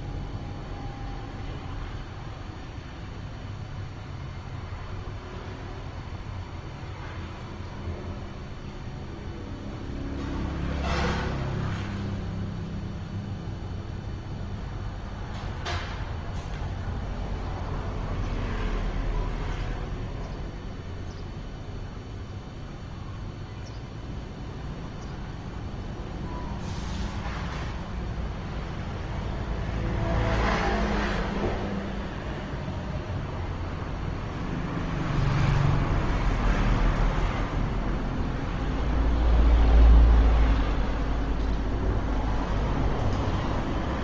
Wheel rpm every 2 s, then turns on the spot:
0, 0, 0, 0, 0, 0, 0, 0, 0, 0, 0, 0, 0, 0, 0, 0, 0, 0, 0, 0, 0, 0.
none